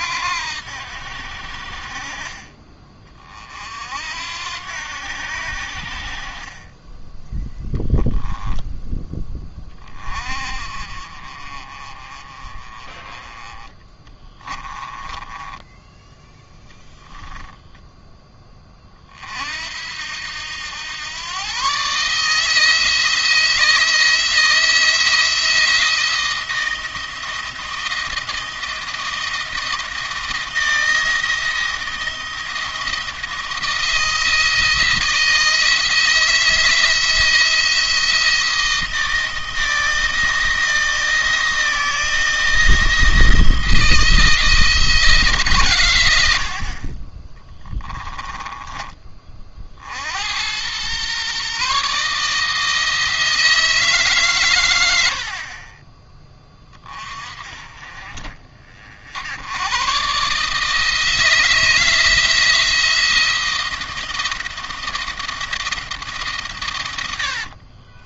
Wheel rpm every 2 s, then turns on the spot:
80, 40, 80, 20, 10, 40, 30, 20, 0, 20, 90, 160, 160, 160, 170, 160, 170, 170, 170, 160, 160, 160, 160, 50, 30, 100, 160, 100, 20, 50, 150, 160, 170, 120.
14-16